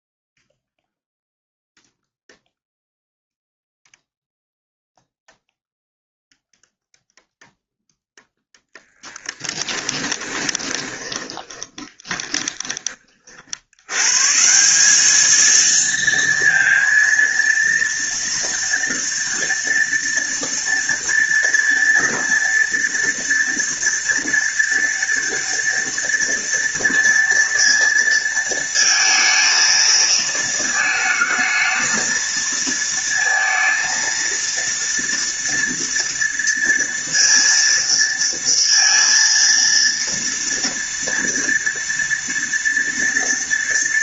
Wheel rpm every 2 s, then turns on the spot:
0, 0, 0, 0, 10, 20, 30, 180, 230, 230, 230, 230, 230, 230, 230, 220, 230, 230, 230, 230, 230, 230.
10-12